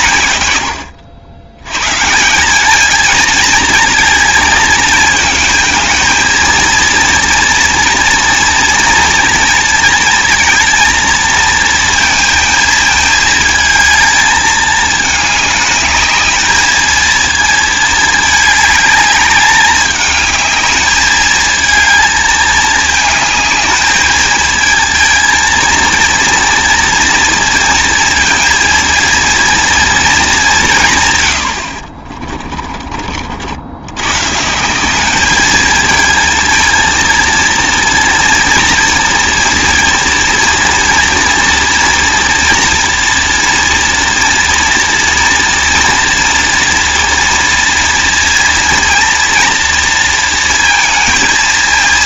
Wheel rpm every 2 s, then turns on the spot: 110, 200, 220, 230, 230, 230, 220, 220, 220, 210, 210, 220, 220, 230, 230, 170, 40, 170, 230, 230, 230, 230, 230, 230, 230, 230.
32-34